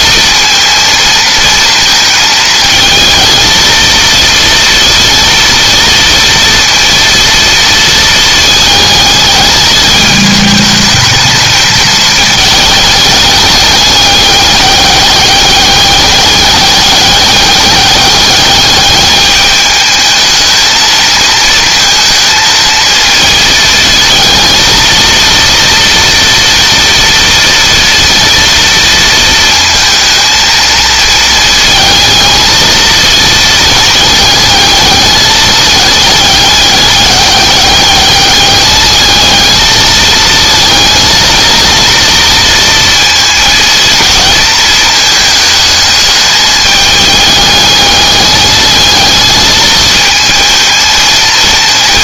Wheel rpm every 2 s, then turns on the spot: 230, 220, 230, 230, 220, 220, 210, 200, 200, 210, 220, 220, 230, 230, 230, 230, 220, 210, 200, 210, 230, 230, 220, 210, 220, 230.
none